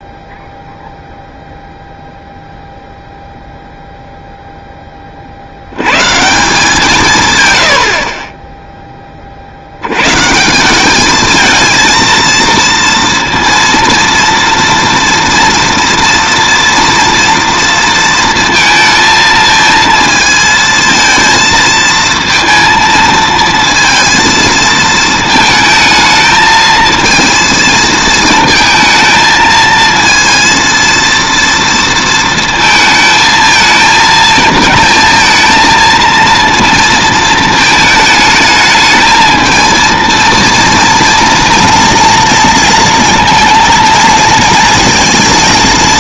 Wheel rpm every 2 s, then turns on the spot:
0, 0, 10, 170, 10, 170, 230, 230, 230, 230, 230, 230, 230, 220, 230, 230, 230, 220, 230, 220, 230, 230, 230.
none